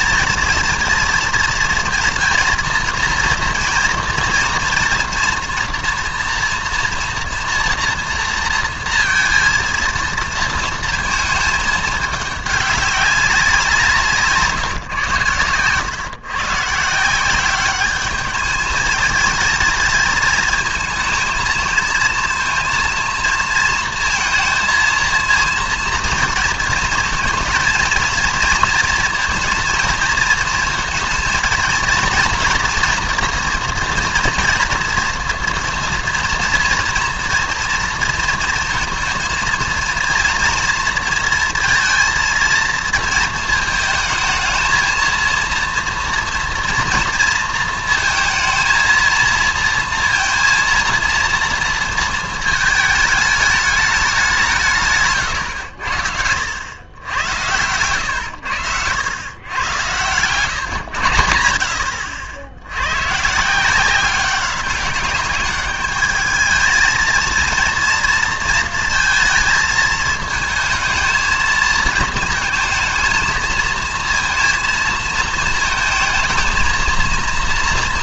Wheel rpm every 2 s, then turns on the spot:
220, 230, 230, 230, 230, 230, 200, 140, 150, 220, 220, 230, 230, 230, 230, 230, 240, 230, 230, 230, 230, 230, 220, 230, 230, 230, 220, 160, 80, 90, 120, 90, 200, 220, 230, 220, 220, 230, 220.
none